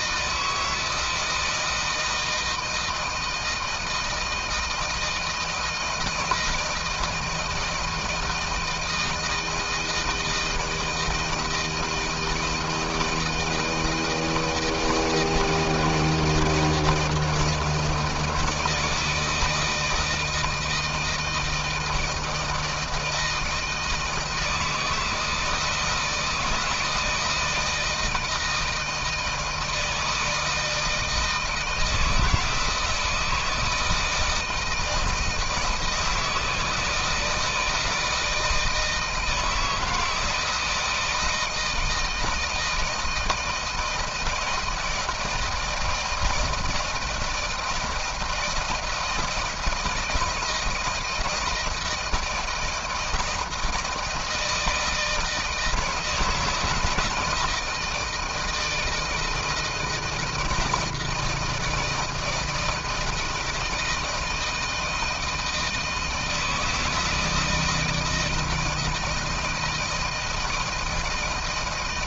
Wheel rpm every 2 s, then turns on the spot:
160, 160, 160, 160, 160, 160, 160, 160, 170, 160, 160, 160, 160, 160, 160, 160, 160, 160, 160, 160, 160, 160, 170, 160, 160, 160, 160, 160, 160, 160, 160, 170, 160, 160, 170, 170.
none